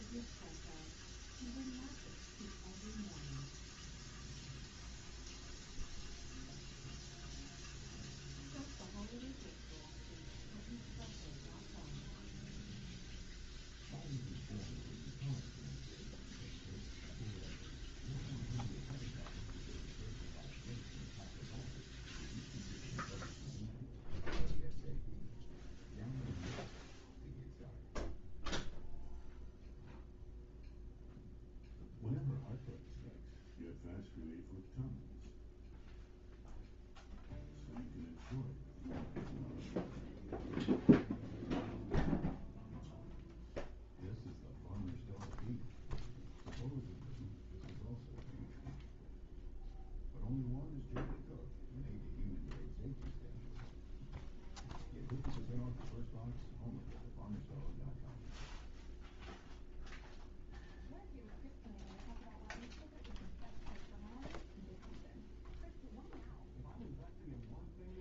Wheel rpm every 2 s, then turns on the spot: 0, 0, 0, 0, 0, 0, 0, 0, 0, 0, 0, 0, 0, 0, 0, 0, 0, 0, 0, 0, 0, 0, 0, 0, 0, 0, 0, 0, 0, 0, 0, 0, 0, 0.
none